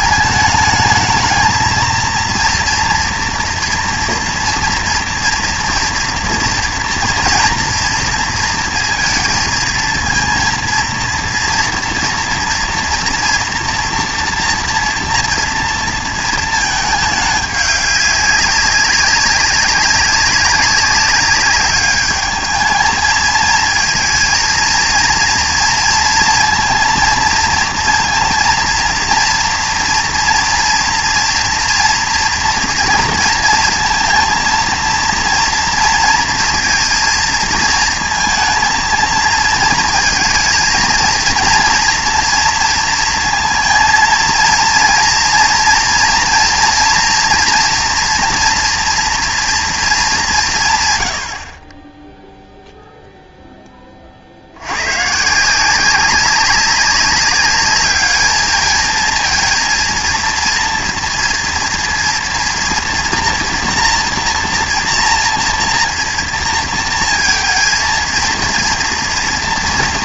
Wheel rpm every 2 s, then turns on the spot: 220, 230, 230, 230, 230, 230, 230, 240, 220, 190, 200, 220, 230, 230, 230, 230, 230, 230, 230, 220, 220, 230, 230, 240, 240, 150, 0, 90, 200, 220, 230, 230, 240, 220, 230.
none